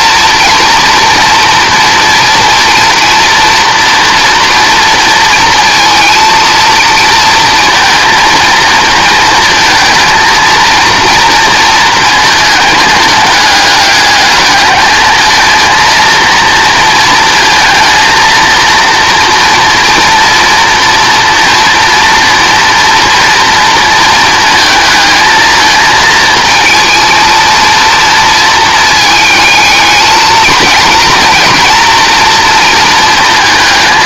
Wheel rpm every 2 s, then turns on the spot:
240, 230, 230, 230, 220, 230, 220, 210, 230, 230, 230, 230, 230, 230, 220, 230, 230.
none